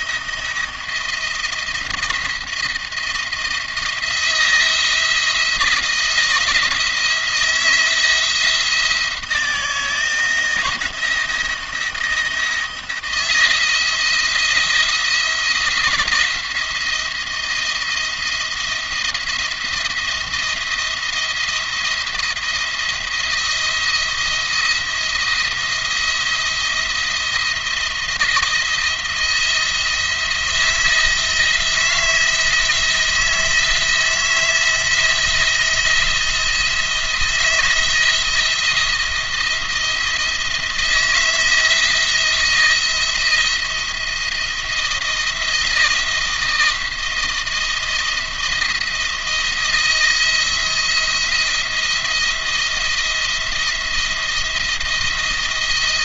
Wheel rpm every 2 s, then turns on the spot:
170, 170, 160, 160, 170, 170, 170, 170, 160, 160, 170, 160, 170, 170, 170, 170, 160, 160, 170, 170, 170, 170, 170, 160, 170, 170, 170, 170.
none